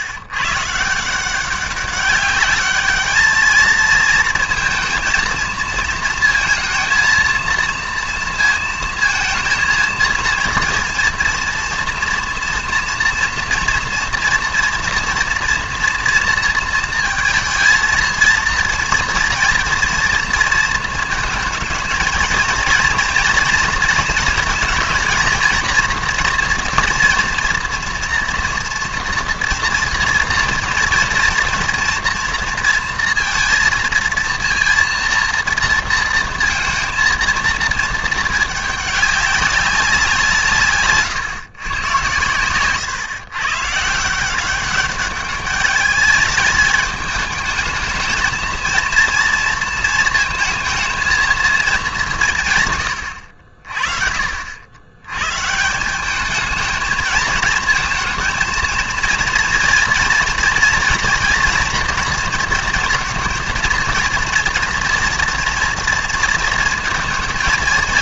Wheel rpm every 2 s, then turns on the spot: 140, 210, 230, 230, 230, 230, 230, 230, 230, 230, 230, 230, 230, 240, 230, 230, 230, 230, 230, 210, 150, 120, 190, 210, 230, 220, 140, 80, 220, 220, 230, 230, 230, 230.
42-44